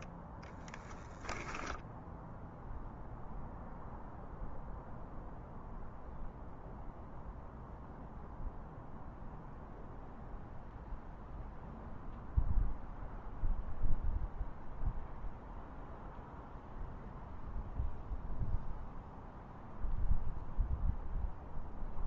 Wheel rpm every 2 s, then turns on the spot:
20, 0, 0, 0, 0, 0, 0, 0, 0, 0, 0.
none